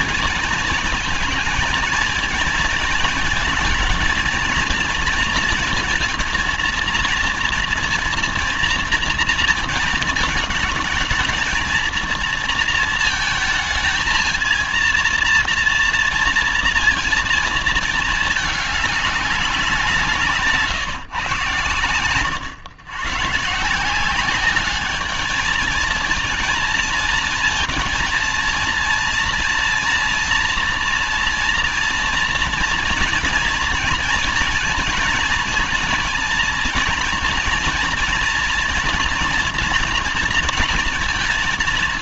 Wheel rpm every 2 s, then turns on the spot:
230, 220, 230, 240, 230, 220, 230, 230, 230, 210, 150, 110, 200, 230, 230, 230, 230, 230, 240, 230, 240.
none